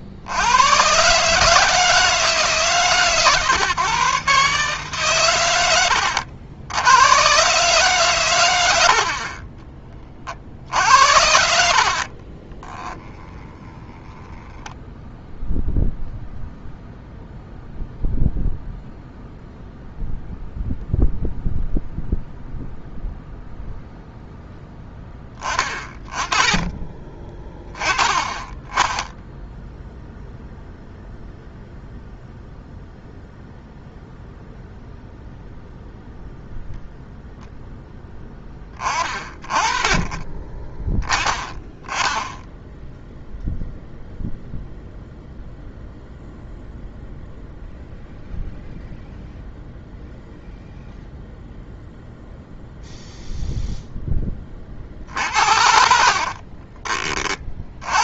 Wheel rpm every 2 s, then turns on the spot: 120, 140, 140, 100, 80, 60, 10, 0, 0, 0, 0, 0, 10, 20, 20, 0, 0, 0, 0, 20, 10, 0, 0, 0, 0, 0, 0, 40, 30.
10-14 56-58